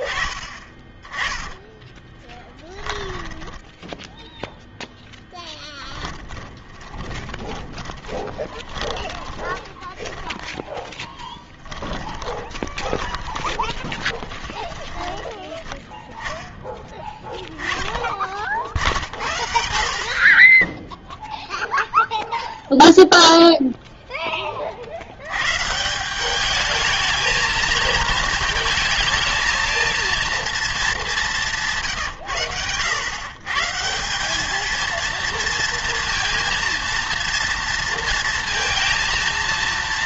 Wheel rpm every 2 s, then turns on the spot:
30, 10, 0, 20, 20, 10, 20, 20, 10, 40, 10, 0, 30, 210, 220, 230, 110, 220, 230, 230.
2-4 6-10 12-16